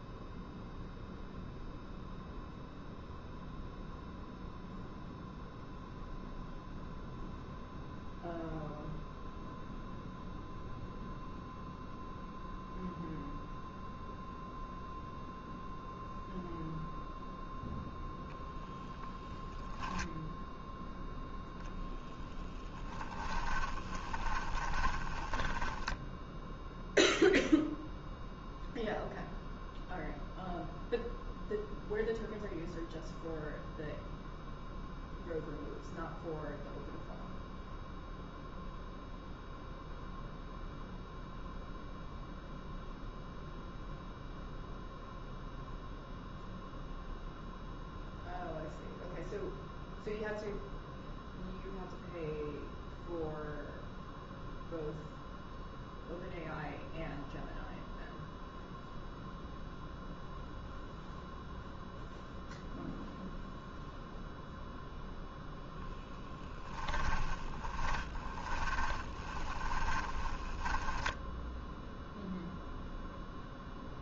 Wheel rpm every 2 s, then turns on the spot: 0, 0, 0, 0, 0, 0, 0, 0, 0, 0, 0, 10, 20, 0, 0, 0, 0, 0, 0, 0, 0, 0, 0, 0, 0, 0, 0, 0, 0, 0, 0, 0, 0, 10, 20, 10, 0.
22-26 66-72